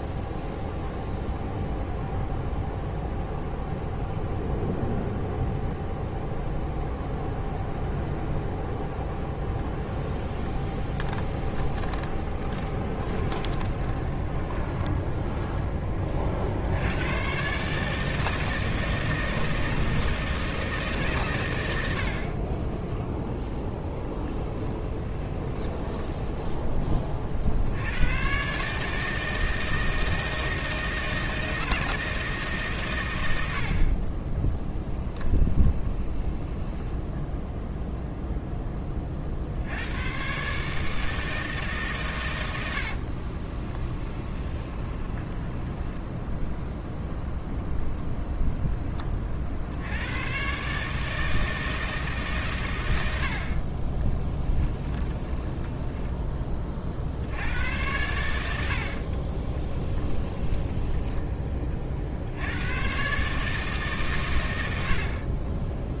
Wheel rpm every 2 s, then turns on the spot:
0, 0, 0, 0, 0, 10, 20, 10, 90, 160, 150, 10, 10, 20, 150, 160, 120, 10, 10, 20, 150, 70, 20, 0, 10, 140, 100, 10, 40, 70, 10, 110, 80.
10-16 22-26 34-38 42-46 54-56 58-62